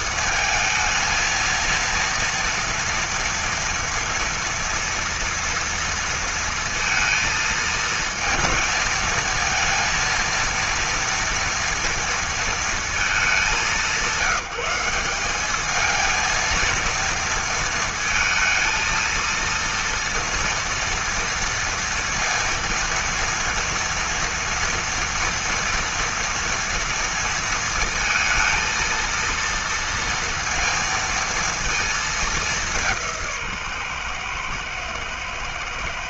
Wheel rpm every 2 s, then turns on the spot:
220, 230, 230, 230, 220, 230, 230, 190, 230, 230, 230, 230, 230, 230, 230, 230, 180, 120.
none